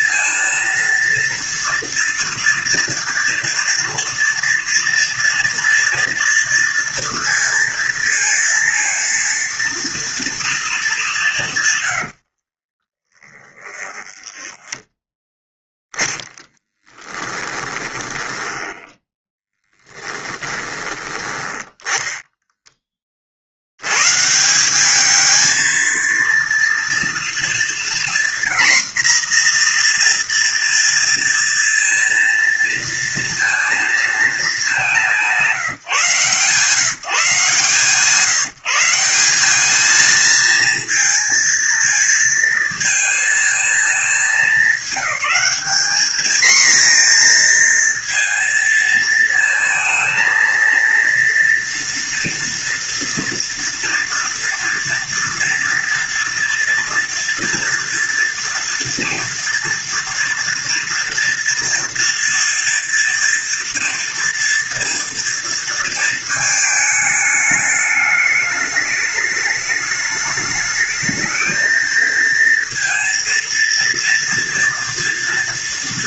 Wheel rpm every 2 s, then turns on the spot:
230, 230, 230, 230, 230, 220, 40, 10, 10, 20, 20, 20, 180, 240, 240, 230, 230, 200, 160, 160, 230, 230, 200, 230, 230, 230, 240, 230, 230, 230, 230, 230, 230, 220, 210, 210, 230, 230.
12-22